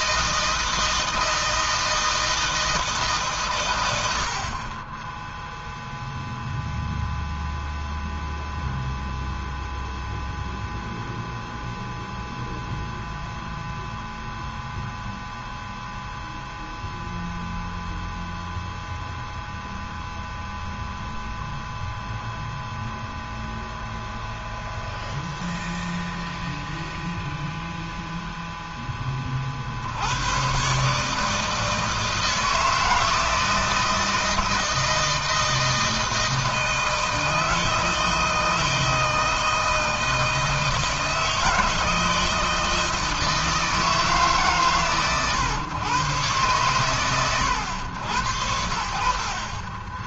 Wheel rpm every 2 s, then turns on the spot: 160, 160, 40, 0, 0, 0, 0, 0, 0, 0, 0, 0, 0, 0, 0, 120, 160, 160, 160, 160, 160, 160, 140, 120, 90.
none